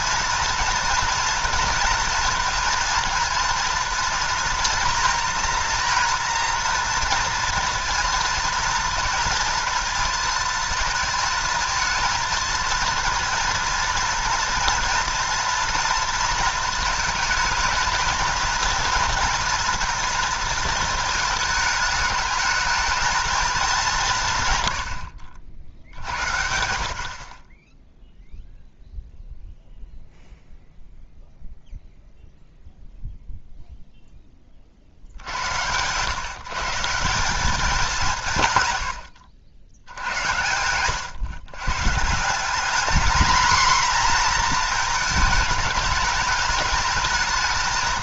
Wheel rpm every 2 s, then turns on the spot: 230, 230, 230, 230, 230, 220, 230, 230, 220, 220, 220, 210, 100, 60, 0, 0, 0, 30, 140, 120, 100, 210, 230, 210.
38-40